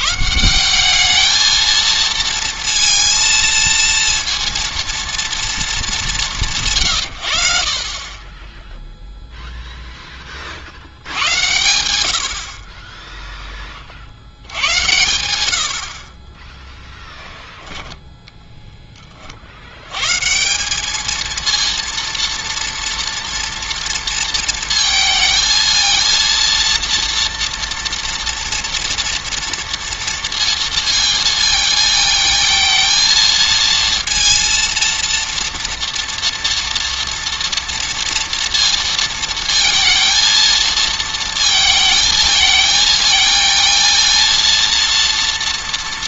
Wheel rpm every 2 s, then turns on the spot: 200, 230, 230, 150, 0, 70, 30, 100, 10, 10, 190, 230, 230, 230, 230, 230, 230, 230, 230, 220, 230, 220, 230.
16-18